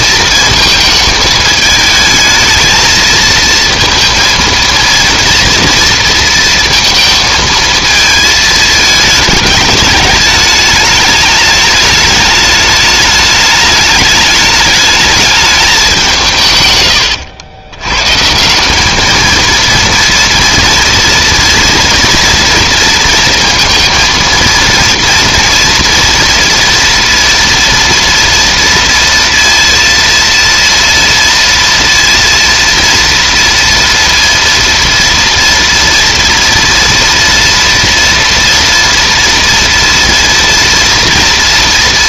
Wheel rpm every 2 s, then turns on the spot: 220, 220, 230, 220, 210, 210, 210, 210, 120, 210, 240, 230, 230, 230, 230, 230, 230, 230, 230, 230, 230.
none